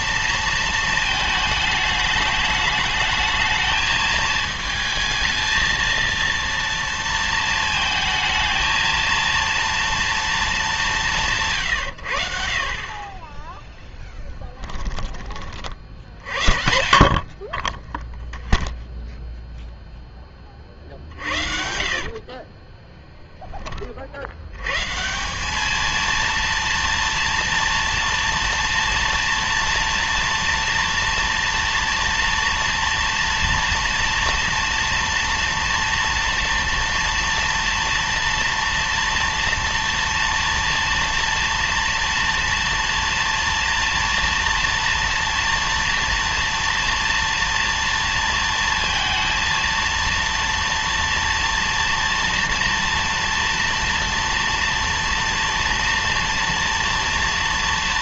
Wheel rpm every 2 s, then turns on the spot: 230, 210, 220, 230, 220, 220, 50, 10, 50, 0, 30, 30, 100, 230, 230, 230, 230, 240, 230, 230, 240, 230, 230, 230, 230, 230, 230, 230, 230.
14-16 20-24